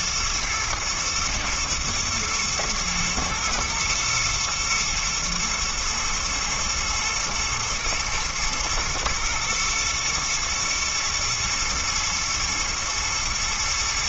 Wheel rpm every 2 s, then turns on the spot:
110, 110, 110, 110, 110, 110, 110.
none